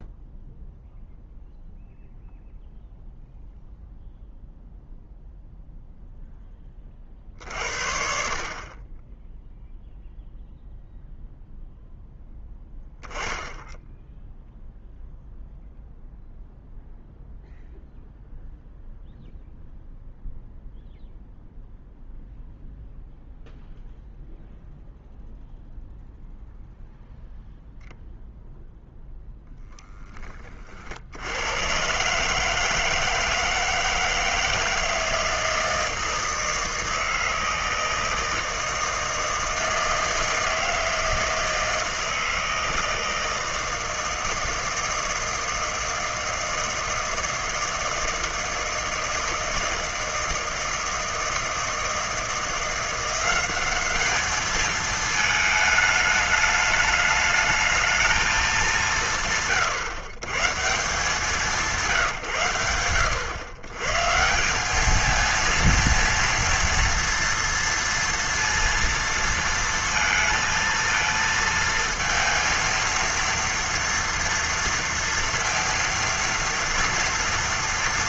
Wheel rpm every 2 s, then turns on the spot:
0, 0, 0, 30, 30, 0, 10, 0, 0, 0, 0, 0, 0, 0, 0, 70, 160, 160, 160, 160, 160, 160, 160, 160, 160, 160, 170, 220, 210, 190, 160, 110, 200, 230, 230, 230, 230, 230, 230.
none